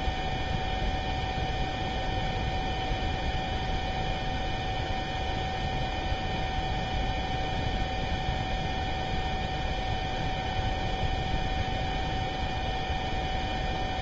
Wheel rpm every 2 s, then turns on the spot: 0, 0, 0, 0, 0, 0, 0.
none